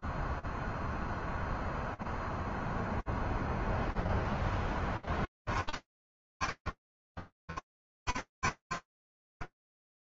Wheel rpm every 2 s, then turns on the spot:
0, 0, 10, 30, 40.
none